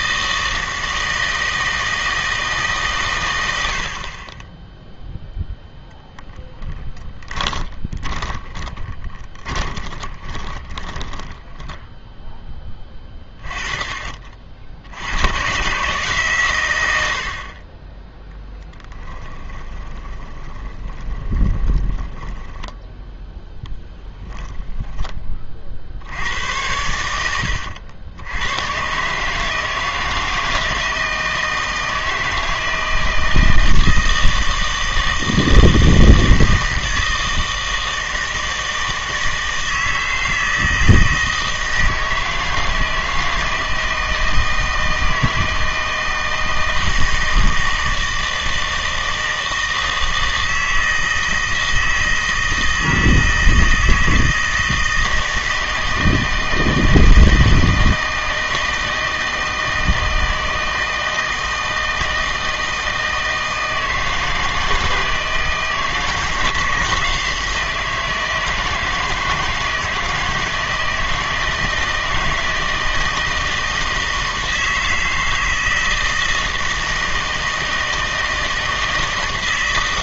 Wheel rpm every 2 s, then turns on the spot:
160, 150, 10, 10, 20, 20, 10, 70, 100, 10, 20, 10, 10, 90, 110, 160, 160, 160, 160, 160, 160, 160, 160, 160, 160, 160, 160, 160, 160, 160, 160, 160, 160, 160, 160, 160, 160, 160, 160, 160.
6-12 18-24